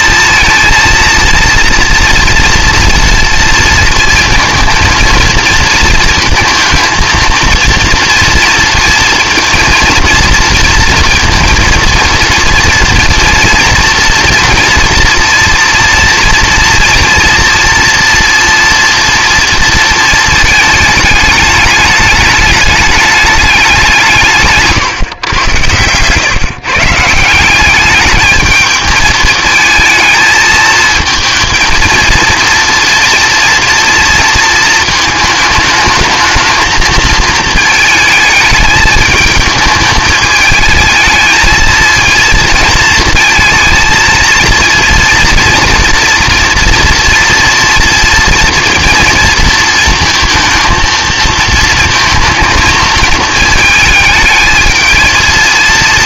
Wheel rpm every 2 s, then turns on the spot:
230, 230, 230, 230, 230, 230, 230, 230, 230, 230, 220, 210, 150, 140, 220, 220, 230, 220, 220, 220, 220, 230, 230, 230, 230, 230, 230, 220.
24-26